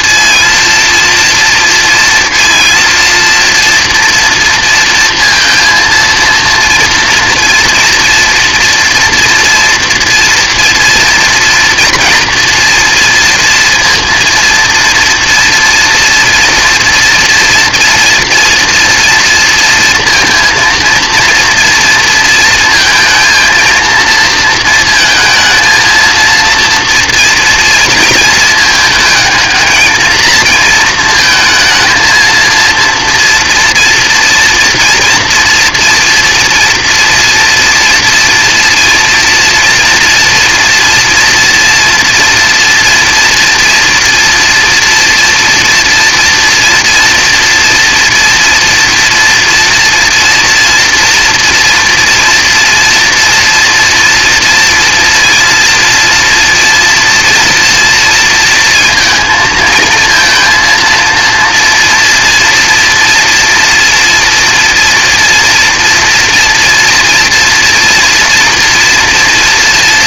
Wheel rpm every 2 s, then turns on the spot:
230, 230, 230, 230, 230, 230, 230, 230, 230, 230, 230, 220, 230, 230, 220, 220, 230, 230, 230, 230, 240, 230, 230, 230, 240, 230, 240, 230, 240, 230, 230, 240, 240, 230, 230.
none